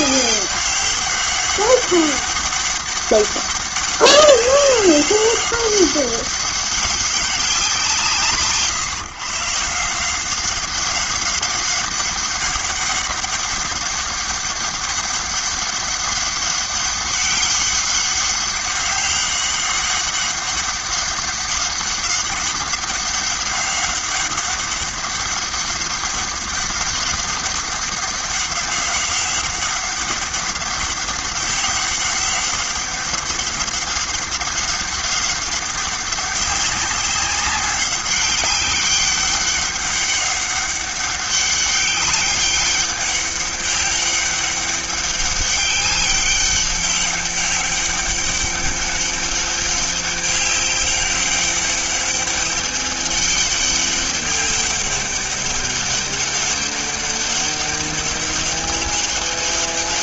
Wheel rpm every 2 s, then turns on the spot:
200, 200, 200, 200, 150, 190, 200, 200, 200, 200, 200, 200, 200, 200, 200, 200, 200, 200, 190, 200, 200, 200, 200, 200, 200, 200, 200, 200, 190, 190.
none